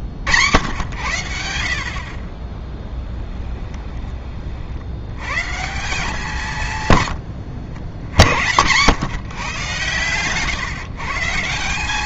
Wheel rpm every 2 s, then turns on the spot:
100, 20, 60, 130, 100, 140.
none